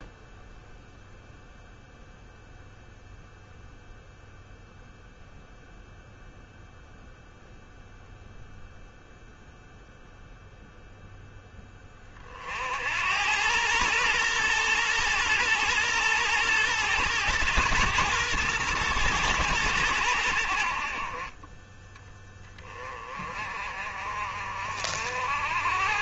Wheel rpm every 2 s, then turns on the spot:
0, 0, 0, 0, 0, 0, 70, 120, 120, 110, 50, 20, 50.
none